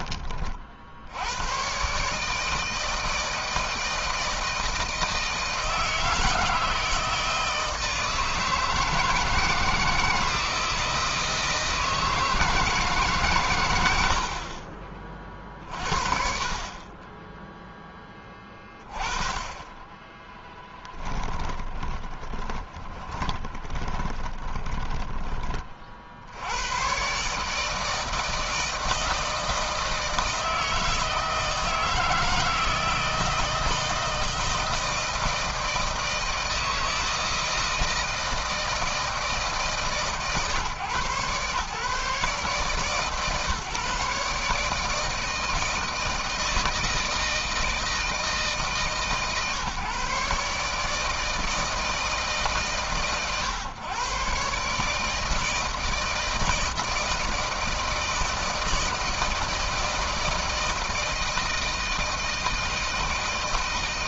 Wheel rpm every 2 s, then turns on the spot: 70, 160, 160, 160, 160, 160, 150, 30, 20, 20, 10, 30, 20, 120, 160, 160, 160, 160, 160, 160, 140, 140, 150, 160, 150, 150, 140, 150, 160, 160, 160, 160.
20-26